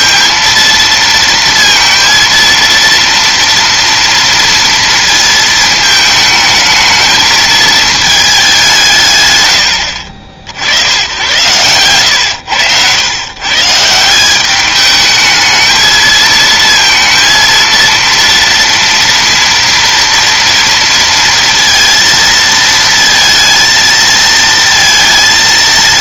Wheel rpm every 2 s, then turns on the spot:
230, 230, 220, 220, 100, 100, 120, 220, 230, 230, 230, 230, 230.
none